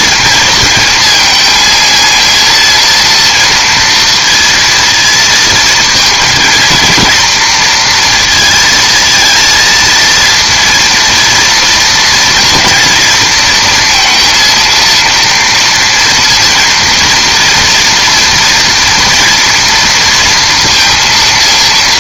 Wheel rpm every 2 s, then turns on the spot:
220, 230, 230, 230, 220, 230, 230, 230, 230, 230, 230.
none